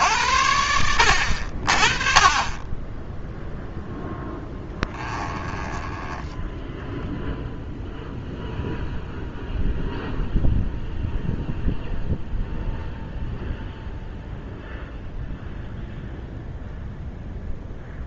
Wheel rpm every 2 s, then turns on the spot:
80, 10, 10, 0, 0, 0, 0, 0, 0.
4-6